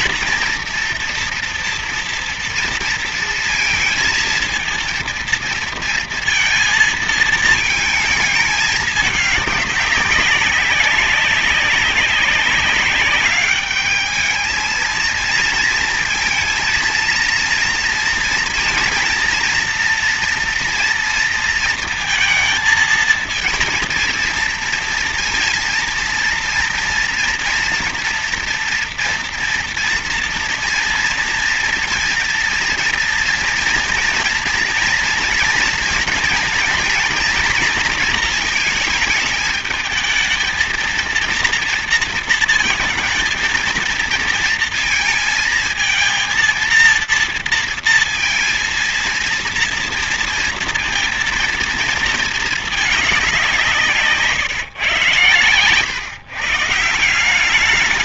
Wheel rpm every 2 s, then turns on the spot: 230, 230, 230, 230, 210, 200, 200, 220, 230, 230, 240, 230, 230, 230, 230, 230, 230, 230, 230, 220, 220, 230, 230, 230, 230, 230, 230, 140, 140.
none